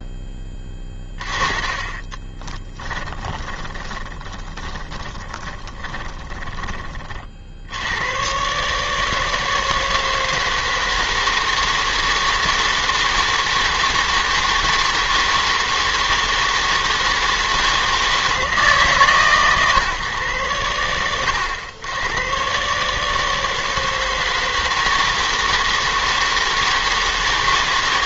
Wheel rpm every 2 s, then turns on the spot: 20, 10, 20, 40, 150, 160, 160, 160, 160, 150, 80, 150, 160, 160.
2-6